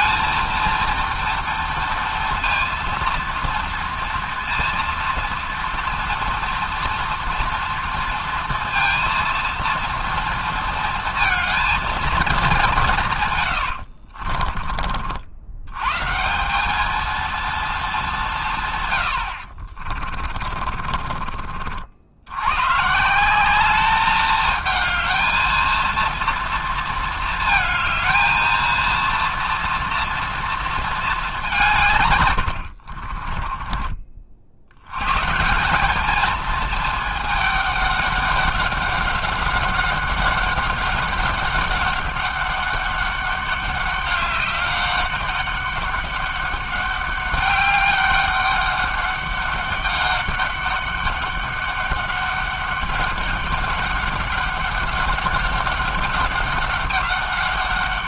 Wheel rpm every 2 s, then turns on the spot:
230, 230, 240, 240, 230, 230, 200, 40, 190, 150, 30, 120, 220, 230, 230, 230, 80, 90, 220, 200, 200, 200, 200, 200, 200, 200, 200, 200, 200.
14-16 20-22 32-34